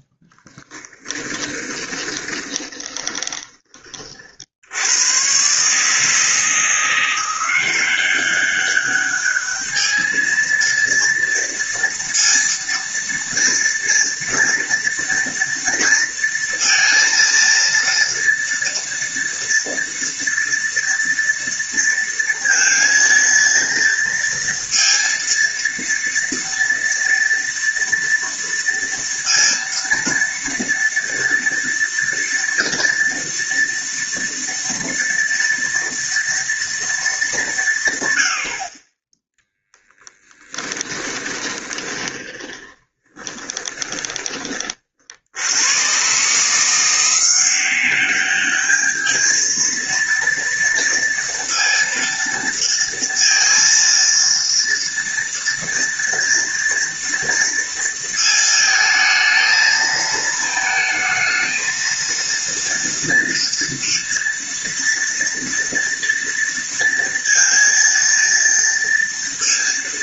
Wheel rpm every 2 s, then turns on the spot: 10, 20, 70, 160, 200, 230, 230, 230, 230, 230, 230, 230, 230, 230, 230, 230, 230, 230, 230, 50, 20, 20, 30, 160, 210, 230, 230, 230, 230, 220, 220, 230, 230, 230, 230.
0-4 40-44